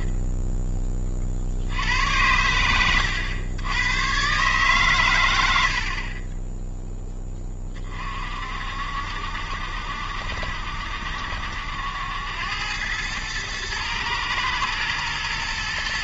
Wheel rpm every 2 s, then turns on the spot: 20, 90, 130, 10, 60, 70, 100, 110.
none